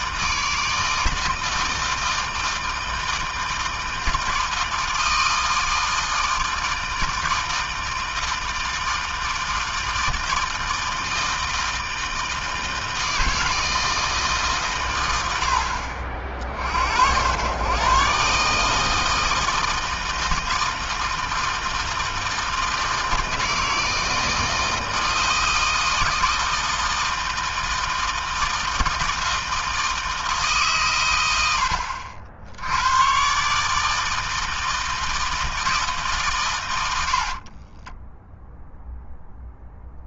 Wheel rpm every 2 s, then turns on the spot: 160, 160, 160, 160, 160, 160, 160, 90, 90, 160, 160, 160, 160, 160, 160, 110, 120, 160, 80, 0.
36-38